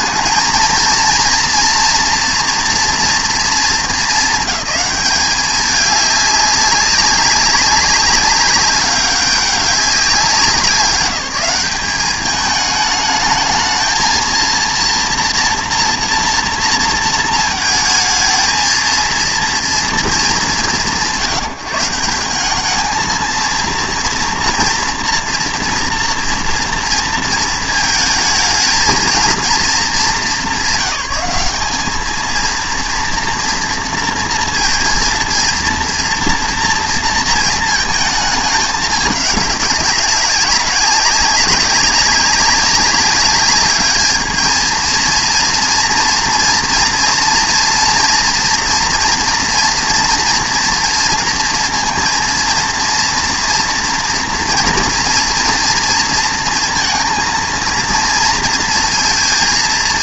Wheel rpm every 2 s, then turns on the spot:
230, 230, 210, 200, 200, 190, 210, 230, 230, 220, 190, 210, 230, 230, 230, 180, 230, 230, 230, 210, 190, 200, 220, 230, 230, 230, 230, 240, 230, 230.
none